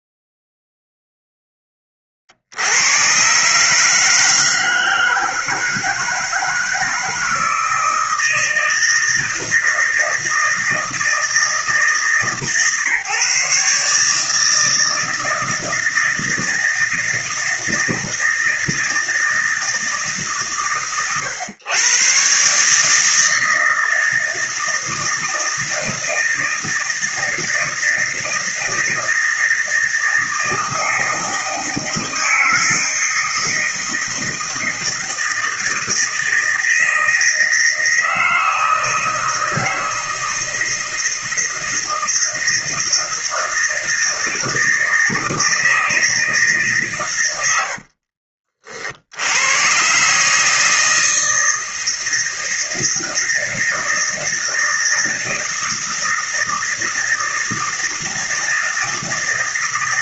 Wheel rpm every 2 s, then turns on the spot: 0, 100, 160, 160, 160, 160, 140, 160, 160, 160, 120, 150, 160, 160, 160, 160, 160, 160, 160, 160, 160, 160, 160, 130, 60, 160, 160, 160, 160, 160.
none